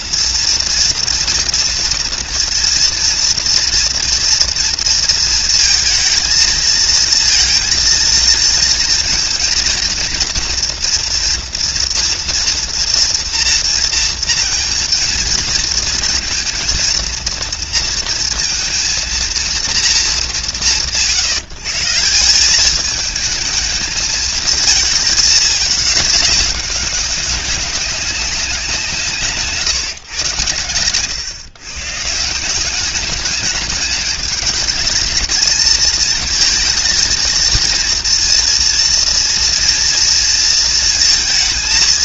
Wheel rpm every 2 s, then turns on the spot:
230, 230, 230, 220, 230, 230, 230, 230, 230, 230, 150, 190, 220, 200, 180, 110, 180, 210, 220, 230, 230.
none